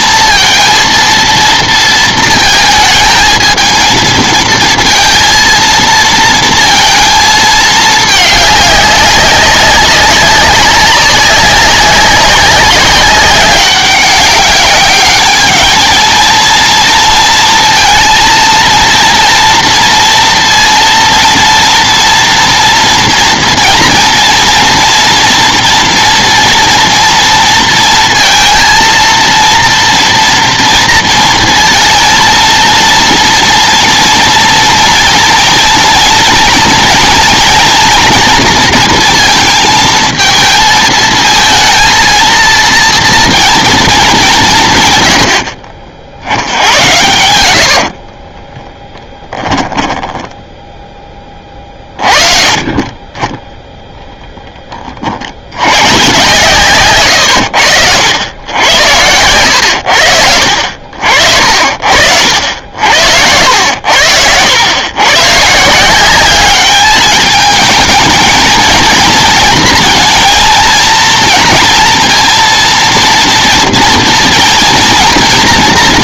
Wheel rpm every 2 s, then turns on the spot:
230, 220, 230, 230, 210, 200, 190, 200, 230, 230, 230, 240, 240, 230, 230, 230, 230, 240, 230, 230, 220, 230, 170, 80, 20, 10, 30, 10, 140, 90, 70, 70, 90, 200, 230, 230, 230, 230.
48-50 54-56 58-60